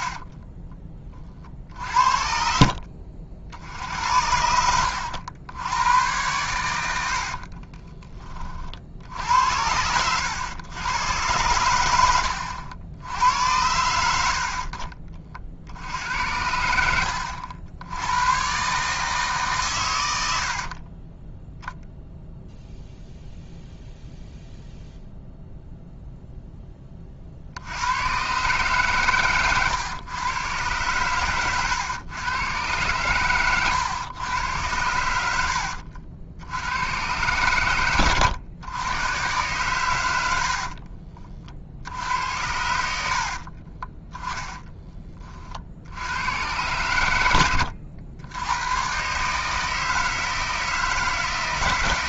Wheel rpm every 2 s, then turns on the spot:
20, 60, 90, 90, 50, 100, 80, 50, 80, 140, 60, 0, 0, 10, 140, 110, 110, 90, 100, 110, 50, 70, 10, 100, 110, 160.
6-8 14-16 20-22 40-42